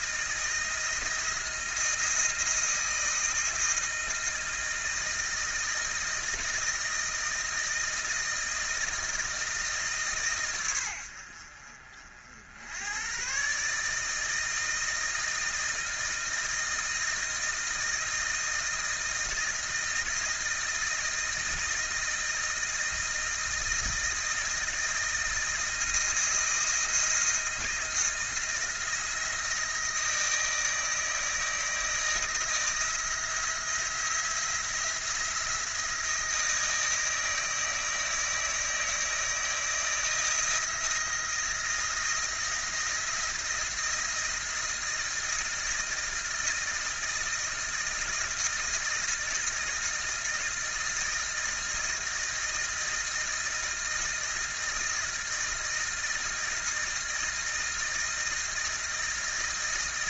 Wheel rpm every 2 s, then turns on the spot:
160, 160, 160, 160, 160, 90, 110, 160, 160, 160, 160, 160, 160, 160, 160, 160, 170, 170, 160, 160, 160, 160, 160, 160, 160, 160, 160, 160, 160, 160.
none